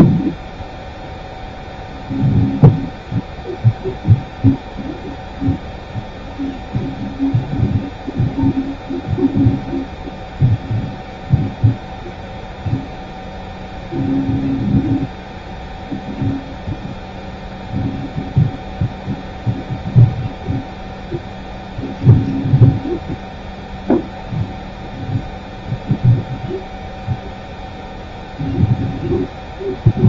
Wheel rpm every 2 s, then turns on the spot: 0, 0, 0, 0, 0, 0, 0, 0, 0, 0, 0, 0, 0, 0, 0.
none